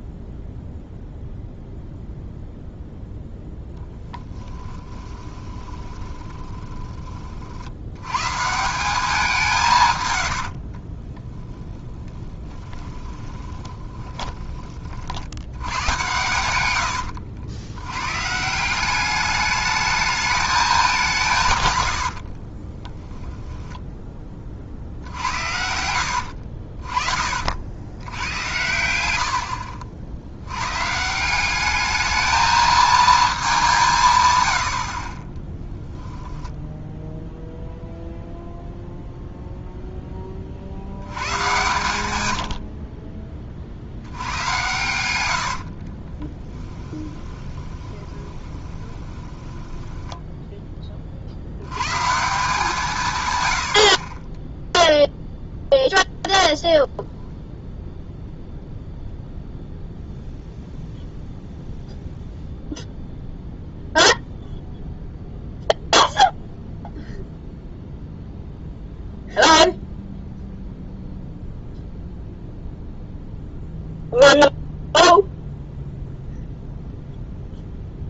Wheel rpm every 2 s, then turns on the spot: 0, 0, 10, 20, 170, 50, 20, 40, 90, 170, 200, 20, 50, 50, 90, 130, 220, 80, 0, 0, 60, 50, 100, 10, 20, 20, 170, 0, 0, 0, 0, 0, 0, 0, 0, 0, 0, 0, 0.
4-6 10-14 22-24 26-28 46-50